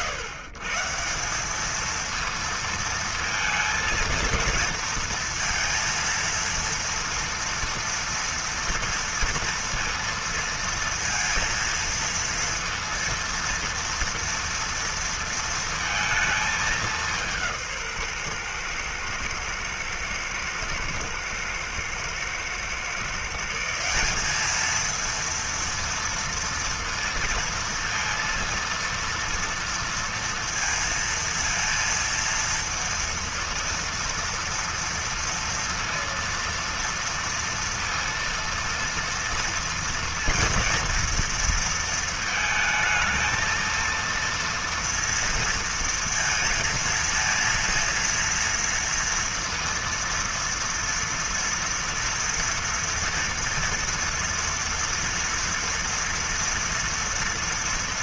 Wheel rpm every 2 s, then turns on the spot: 160, 230, 230, 230, 240, 230, 230, 230, 200, 120, 110, 120, 210, 230, 230, 230, 230, 230, 230, 230, 230, 220, 230, 230, 230, 230, 240, 230, 230.
none